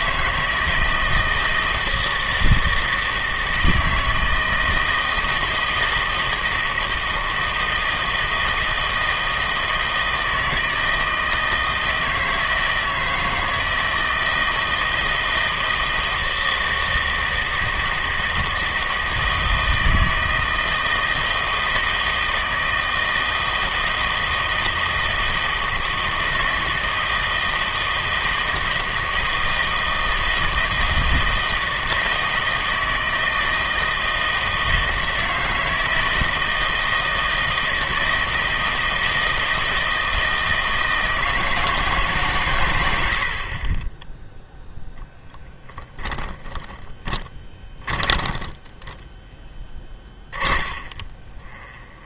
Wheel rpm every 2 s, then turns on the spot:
160, 160, 160, 160, 160, 160, 160, 160, 160, 160, 160, 160, 160, 160, 160, 160, 160, 160, 160, 160, 160, 100, 0, 10, 10, 30.
46-52